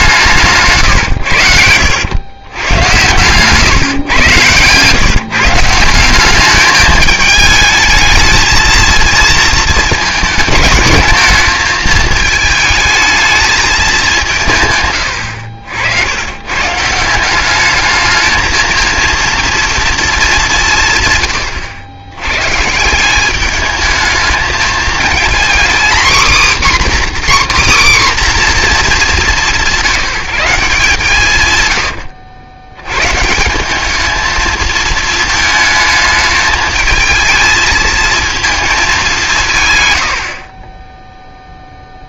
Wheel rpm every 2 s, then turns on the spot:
140, 110, 120, 210, 220, 210, 220, 130, 140, 220, 170, 150, 220, 270, 240, 170, 100, 220, 220, 220, 20.
none